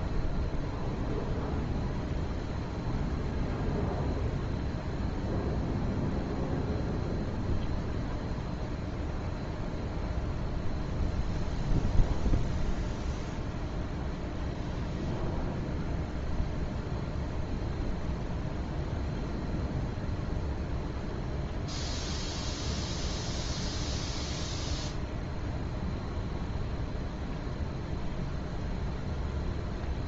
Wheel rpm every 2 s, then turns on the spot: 0, 0, 0, 0, 0, 0, 0, 0, 0, 0, 0, 0, 0, 0, 0.
none